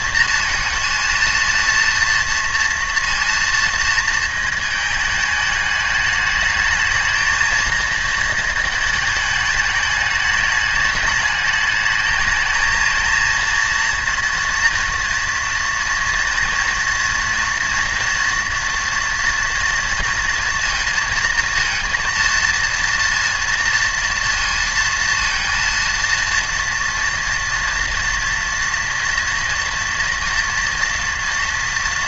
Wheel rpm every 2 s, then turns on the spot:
230, 230, 220, 210, 220, 220, 220, 230, 230, 230, 230, 230, 230, 230, 230, 230.
none